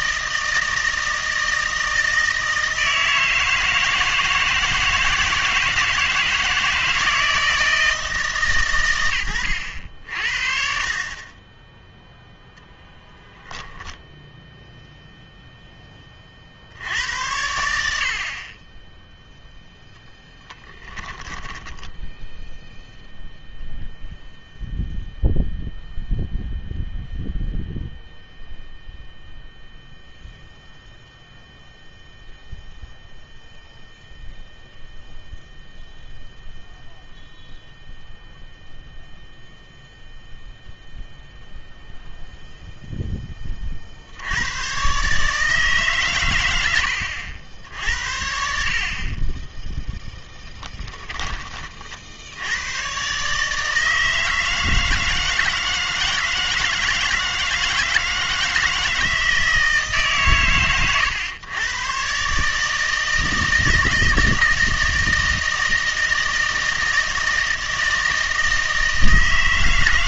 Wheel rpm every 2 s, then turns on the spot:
160, 160, 160, 160, 130, 50, 0, 0, 70, 30, 10, 0, 0, 0, 0, 0, 0, 0, 0, 0, 0, 0, 110, 100, 60, 10, 110, 160, 160, 160, 130, 150, 160, 160, 160.
20-22 50-52